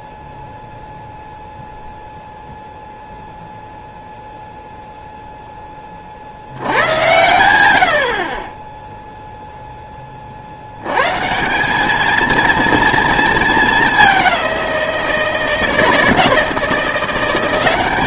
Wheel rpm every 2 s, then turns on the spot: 0, 0, 0, 90, 20, 80, 230, 180, 170.
none